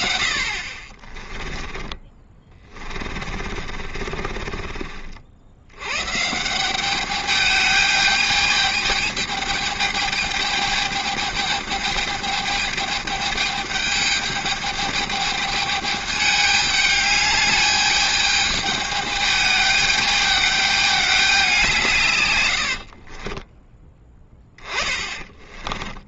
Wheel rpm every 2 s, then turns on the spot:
40, 40, 60, 200, 210, 210, 210, 210, 210, 210, 210, 50, 20.
2-4 22-26